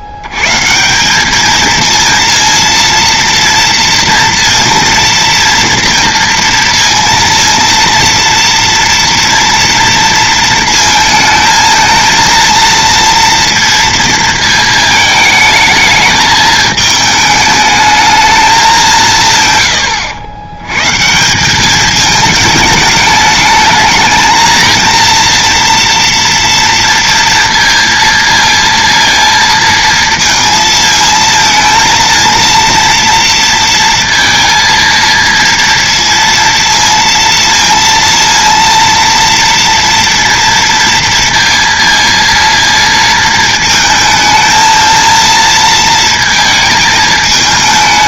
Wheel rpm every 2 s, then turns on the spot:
150, 230, 230, 230, 230, 230, 230, 220, 210, 200, 120, 210, 230, 230, 230, 230, 230, 230, 230, 230, 230, 230, 220, 220.
none